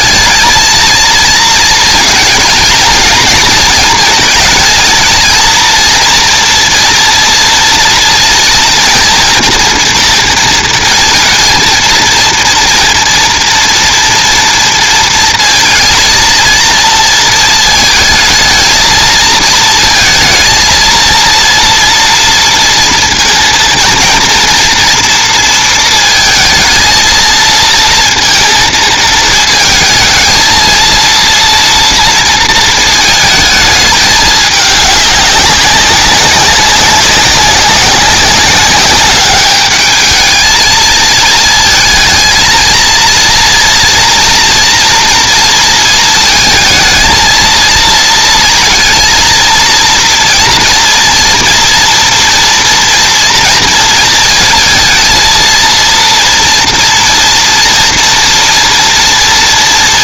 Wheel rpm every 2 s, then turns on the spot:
230, 220, 220, 230, 240, 230, 230, 230, 230, 220, 230, 230, 230, 230, 220, 230, 220, 200, 190, 190, 220, 230, 230, 220, 230, 230, 230, 220, 230, 230.
none